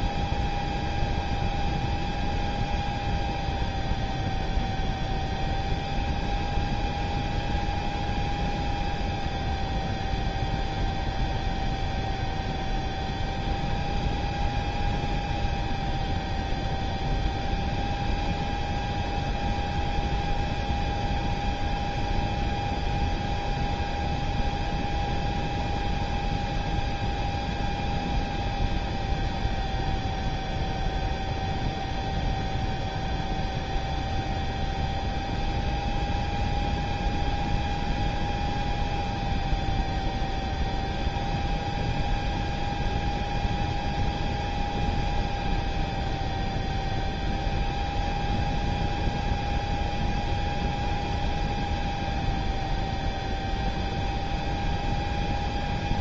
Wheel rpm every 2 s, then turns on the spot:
0, 0, 0, 0, 0, 0, 0, 0, 0, 0, 0, 0, 0, 0, 0, 0, 0, 0, 0, 0, 0, 0, 0, 0, 0, 0, 0, 0.
none